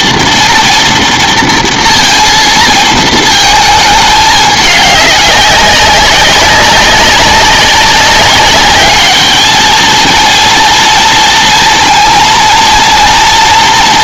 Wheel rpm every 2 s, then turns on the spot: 240, 230, 210, 190, 200, 230, 230.
none